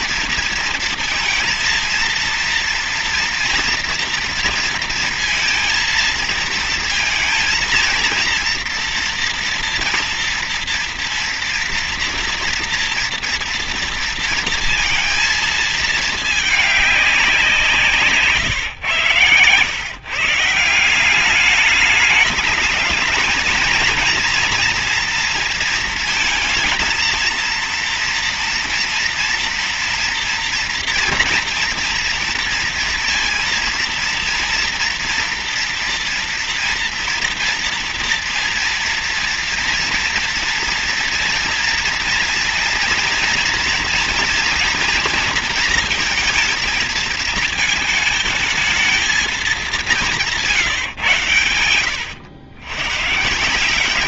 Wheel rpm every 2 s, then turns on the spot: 230, 230, 230, 230, 230, 230, 230, 230, 210, 140, 160, 210, 230, 230, 230, 230, 230, 230, 240, 230, 240, 230, 230, 230, 220, 170, 110.
none